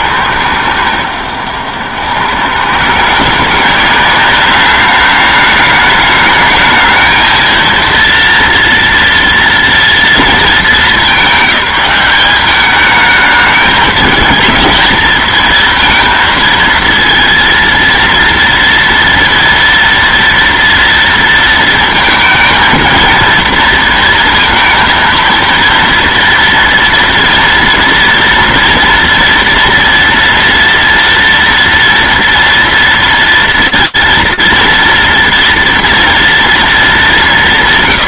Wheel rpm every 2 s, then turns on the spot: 100, 140, 200, 220, 230, 210, 210, 220, 230, 230, 230, 230, 230, 230, 230, 240, 230, 230, 200.
none